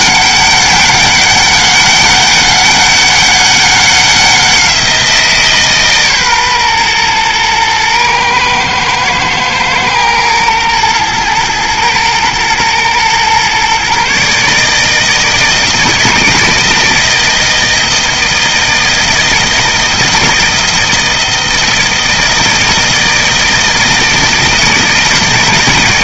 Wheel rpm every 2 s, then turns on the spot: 200, 200, 180, 120, 110, 120, 120, 150, 160, 160, 160, 160, 160.
none